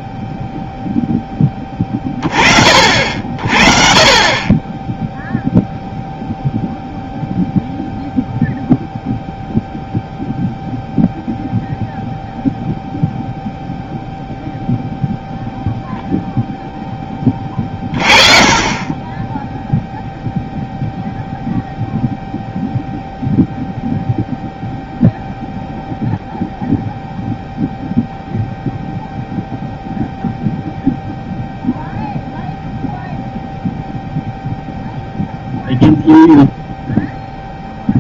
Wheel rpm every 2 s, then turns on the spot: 0, 40, 20, 0, 0, 0, 0, 0, 0, 20, 0, 0, 0, 0, 0, 0, 0, 0, 0.
none